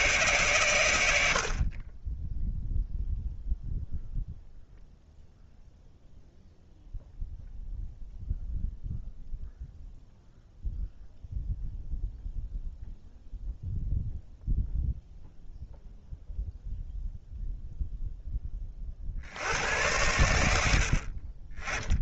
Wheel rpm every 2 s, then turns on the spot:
130, 0, 0, 0, 0, 0, 0, 0, 0, 70, 60.
20-22